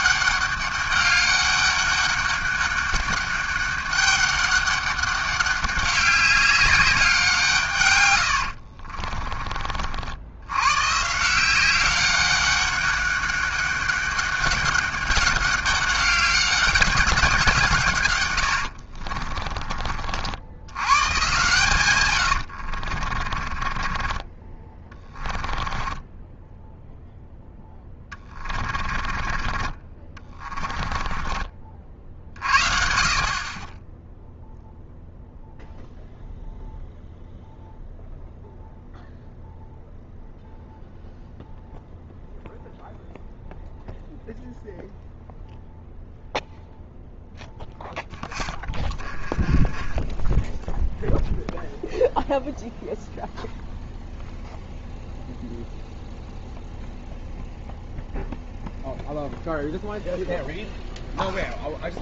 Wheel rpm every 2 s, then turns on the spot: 200, 200, 200, 190, 50, 110, 200, 190, 200, 80, 90, 70, 20, 0, 30, 20, 50, 0, 0, 0, 0, 0, 0, 0, 20, 0, 0, 0, 0, 0, 0.
8-10 18-20 22-26 28-32 48-50